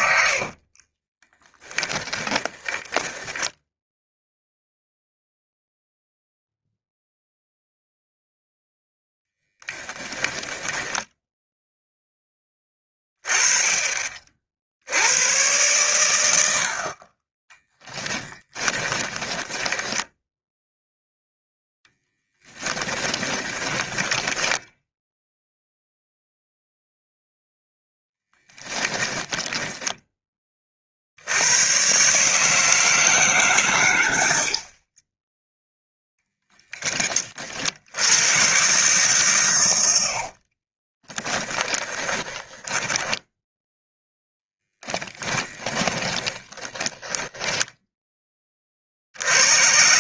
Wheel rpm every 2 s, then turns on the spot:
30, 20, 0, 0, 0, 10, 30, 80, 50, 20, 0, 20, 10, 0, 10, 40, 150, 40, 10, 130, 30, 10, 10, 10, 50.
0-4 10-12 18-20 22-26 28-30 40-48